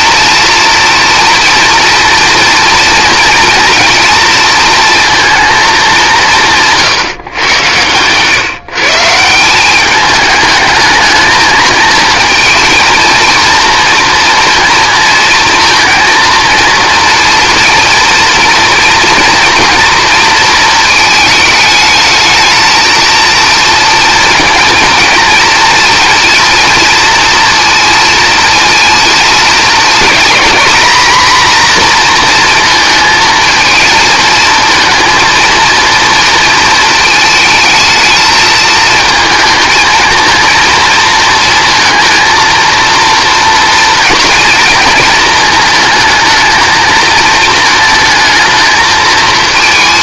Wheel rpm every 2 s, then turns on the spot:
230, 240, 230, 150, 150, 210, 230, 230, 230, 230, 230, 220, 220, 230, 230, 240, 230, 230, 230, 220, 230, 230, 230, 220, 220.
none